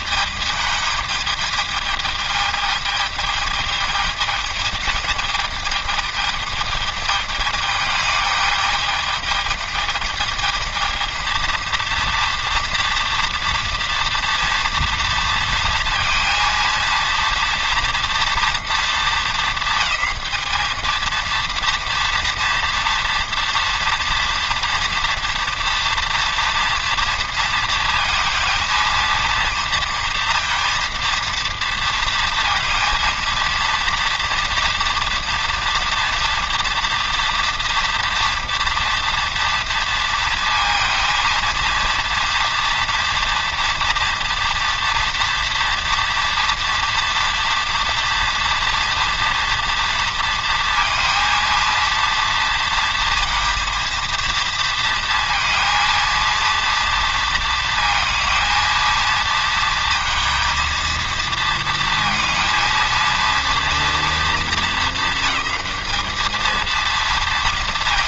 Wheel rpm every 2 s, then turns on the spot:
210, 210, 220, 220, 210, 220, 240, 240, 230, 230, 220, 240, 240, 230, 230, 230, 230, 240, 230, 230, 230, 230, 230, 230, 230, 230, 230, 230, 230, 230, 230, 230, 210, 220.
none